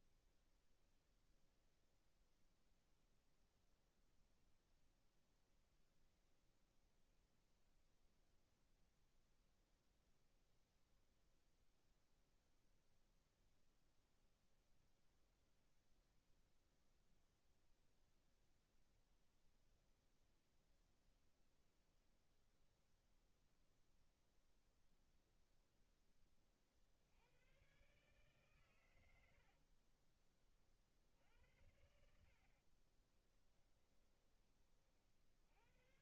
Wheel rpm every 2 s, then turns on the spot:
0, 0, 0, 0, 0, 0, 0, 0, 0, 0, 0, 0, 0, 80, 90, 60, 30, 50.
32-34